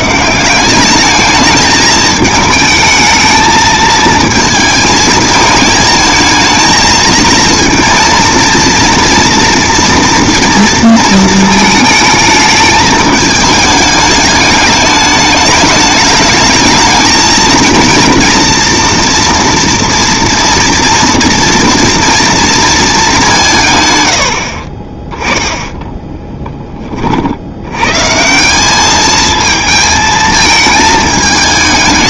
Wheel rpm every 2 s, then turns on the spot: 190, 220, 220, 220, 230, 230, 210, 210, 220, 230, 230, 230, 40, 20, 200, 220.
none